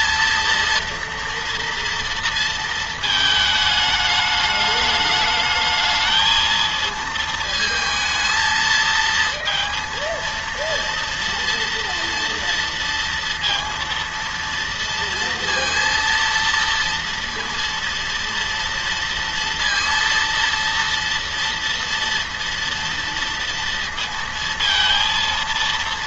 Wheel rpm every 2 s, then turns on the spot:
230, 230, 210, 220, 230, 230, 230, 230, 230, 230, 230, 230, 230.
none